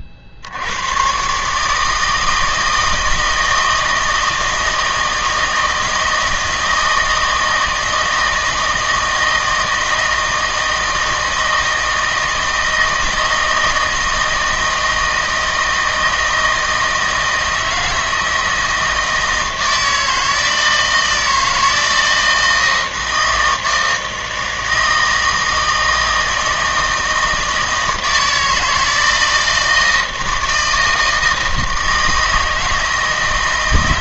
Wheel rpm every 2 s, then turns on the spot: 70, 160, 160, 160, 160, 160, 160, 160, 160, 160, 160, 160, 160, 160, 160, 160, 160.
none